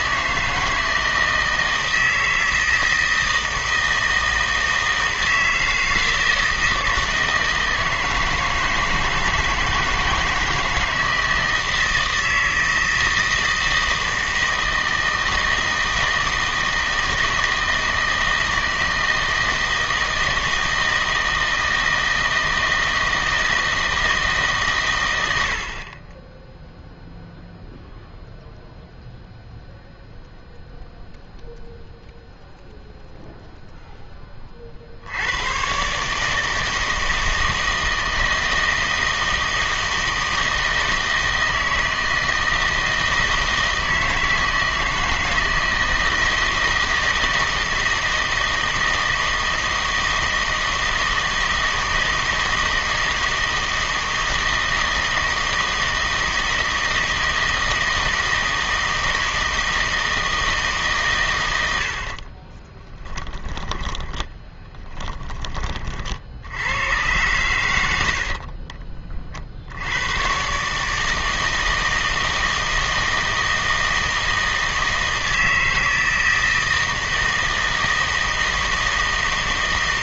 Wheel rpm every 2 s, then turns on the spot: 160, 160, 160, 160, 160, 160, 160, 160, 160, 160, 160, 160, 130, 0, 0, 0, 0, 50, 160, 160, 160, 160, 160, 160, 160, 160, 160, 160, 160, 160, 150, 20, 10, 90, 30, 150, 160, 160, 160, 160.
62-66 68-70